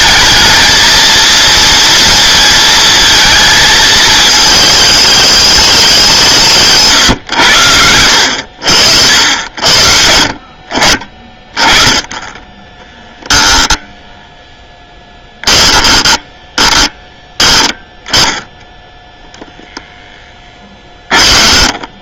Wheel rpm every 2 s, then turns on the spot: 220, 230, 220, 150, 80, 50, 10, 10, 10, 10, 20.
20-22